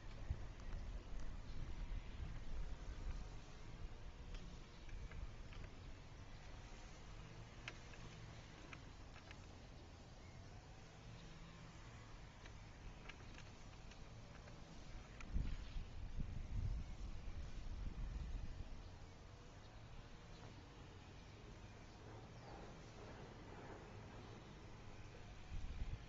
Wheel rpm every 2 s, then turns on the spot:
0, 0, 0, 0, 0, 0, 0, 0, 0, 0, 0, 0, 0.
none